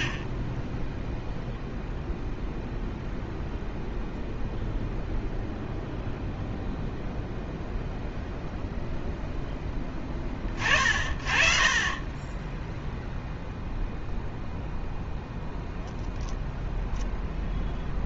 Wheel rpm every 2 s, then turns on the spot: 30, 0, 0, 0, 0, 40, 10, 0, 0.
none